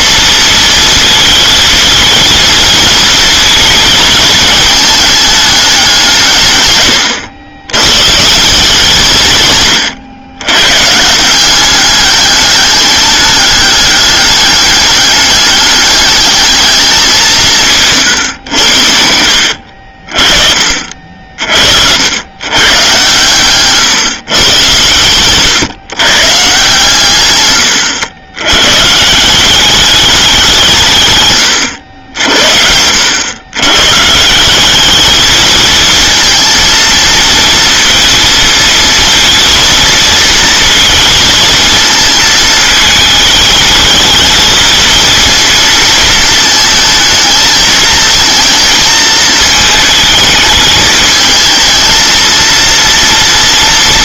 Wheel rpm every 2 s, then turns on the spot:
230, 230, 220, 160, 150, 130, 210, 210, 210, 110, 50, 120, 120, 140, 130, 170, 70, 190, 230, 230, 230, 220, 220, 220, 220, 210, 230.
none